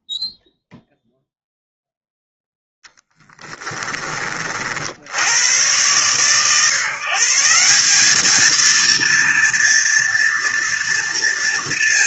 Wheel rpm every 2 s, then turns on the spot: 0, 0, 40, 130, 230, 230.
none